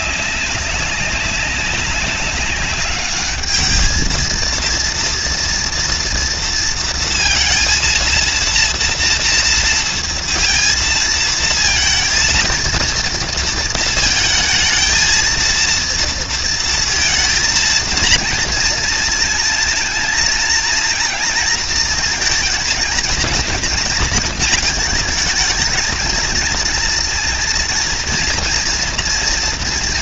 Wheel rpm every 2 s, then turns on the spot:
200, 200, 230, 230, 230, 230, 230, 230, 230, 230, 230, 230, 220, 230, 230.
none